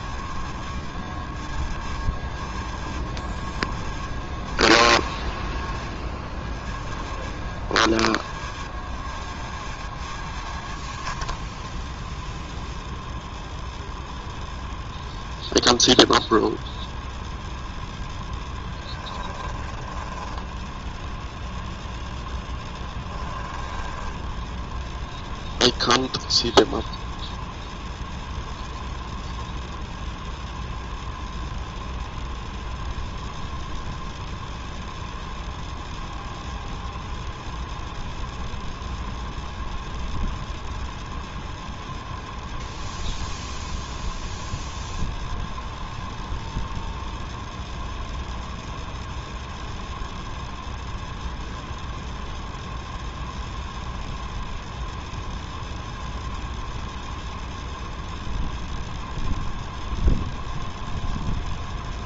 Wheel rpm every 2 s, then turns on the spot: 0, 0, 0, 0, 0, 0, 0, 0, 0, 10, 0, 10, 0, 0, 0, 0, 0, 0, 0, 0, 0, 0, 0, 0, 0, 0, 0, 0, 0, 0, 0.
18-20 22-24